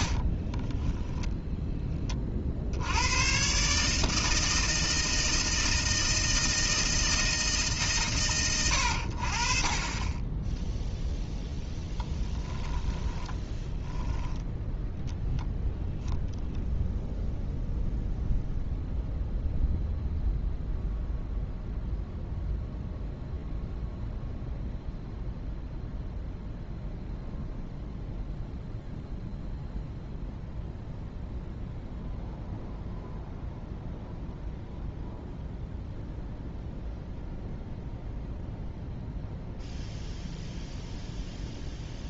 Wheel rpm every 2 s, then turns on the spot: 10, 90, 160, 160, 70, 0, 10, 0, 0, 0, 0, 0, 0, 0, 0, 0, 0, 0, 0, 0, 0.
0-2 12-14